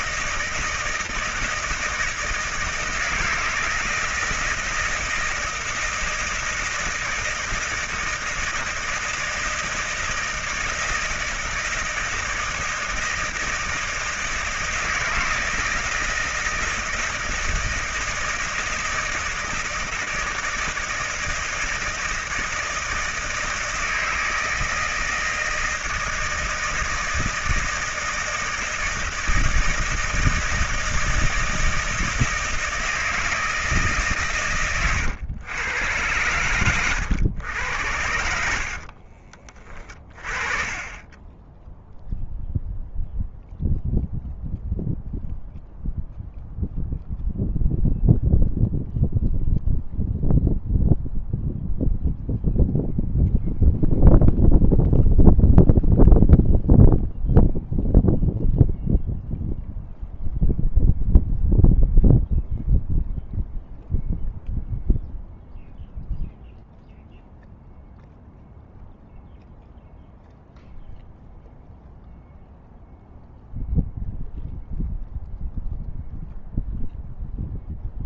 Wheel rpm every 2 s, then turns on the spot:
160, 160, 160, 160, 160, 170, 160, 160, 160, 160, 160, 160, 160, 160, 160, 160, 160, 110, 110, 60, 30, 0, 0, 0, 0, 0, 0, 0, 0, 0, 0, 0, 0, 0, 0, 0, 0, 0, 0.
38-40